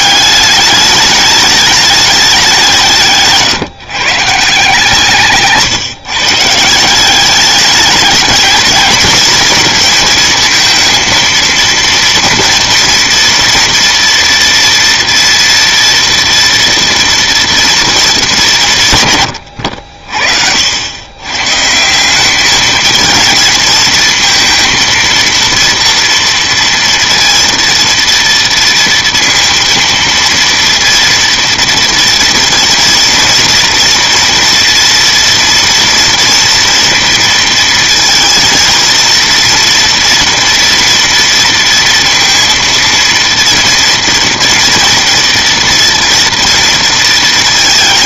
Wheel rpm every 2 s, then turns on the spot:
210, 190, 160, 160, 220, 230, 240, 230, 230, 180, 70, 210, 230, 230, 230, 230, 230, 230, 230, 230, 230, 230, 230, 230.
none